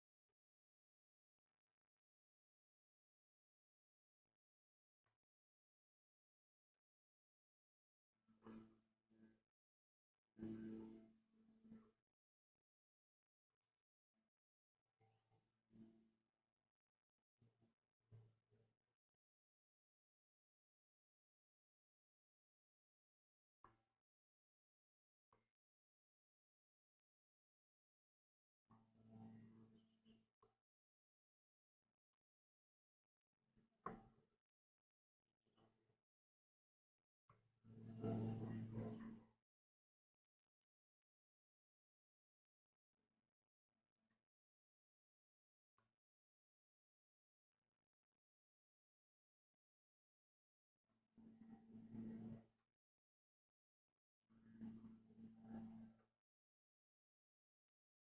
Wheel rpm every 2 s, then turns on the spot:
0, 0, 0, 0, 0, 0, 0, 0, 0, 0, 0, 0, 0, 0, 0, 0, 0, 0, 0, 0, 0, 0, 0, 0, 0, 0, 0, 0, 0.
none